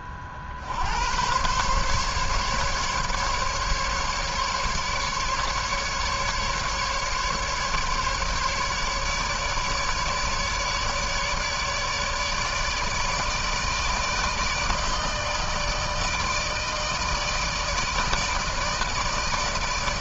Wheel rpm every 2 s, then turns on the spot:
120, 150, 150, 140, 150, 150, 160, 160, 160, 160.
none